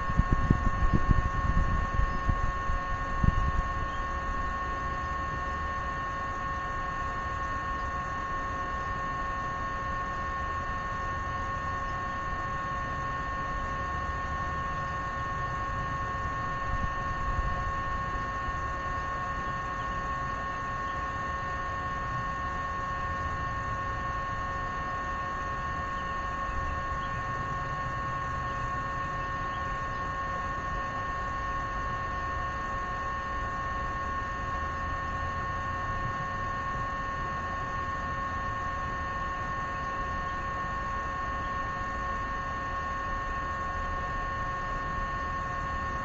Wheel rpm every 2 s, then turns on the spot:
0, 0, 0, 0, 0, 0, 0, 0, 0, 0, 0, 0, 0, 0, 0, 0, 0, 0, 0, 0, 0, 0, 0.
none